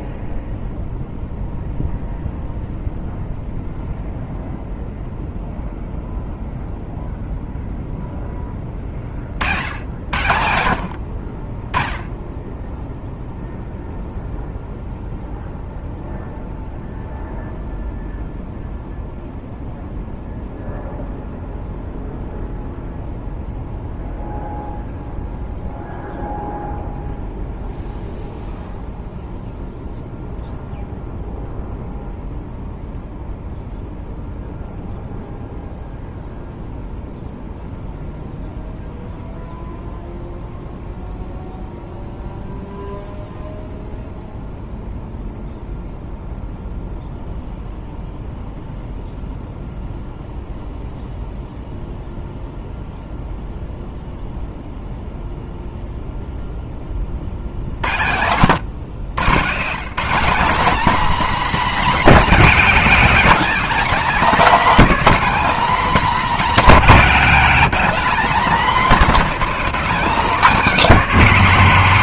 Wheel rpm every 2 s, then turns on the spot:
0, 0, 0, 0, 20, 90, 10, 0, 0, 0, 0, 0, 0, 0, 0, 0, 0, 0, 0, 0, 0, 0, 0, 0, 0, 0, 0, 0, 10, 100, 250, 220, 250, 230, 220, 240.
none